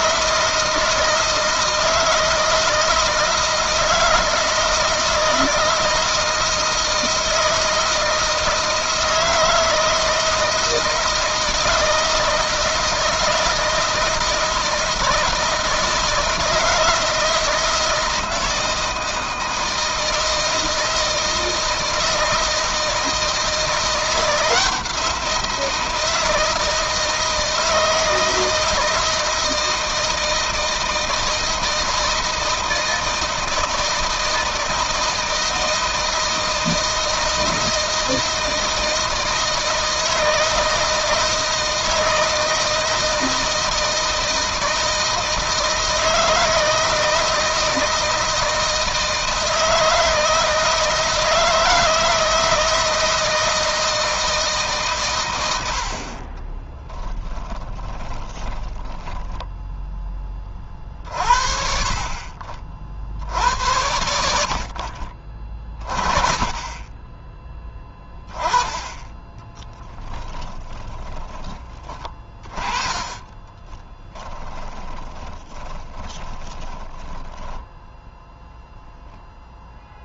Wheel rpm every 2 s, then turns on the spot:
160, 160, 160, 160, 160, 160, 160, 160, 160, 160, 160, 160, 170, 160, 160, 160, 160, 160, 160, 160, 160, 160, 160, 160, 160, 160, 160, 150, 20, 20, 20, 50, 60, 30, 20, 10, 30, 10, 20, 0.
56-60 70-72 74-78